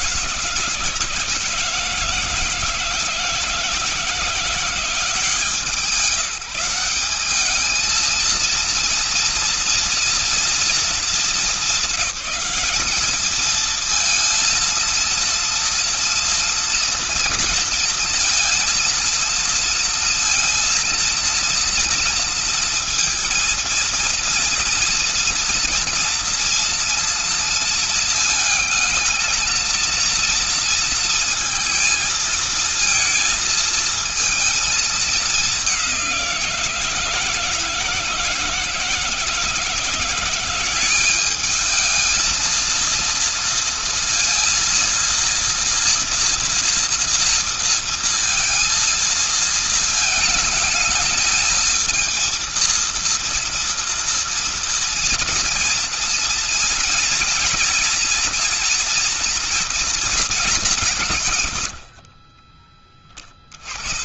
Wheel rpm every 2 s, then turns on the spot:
150, 160, 170, 190, 230, 230, 210, 230, 230, 220, 230, 230, 230, 230, 220, 230, 230, 220, 160, 160, 190, 230, 230, 240, 230, 220, 230, 230, 230, 240, 150, 30.
none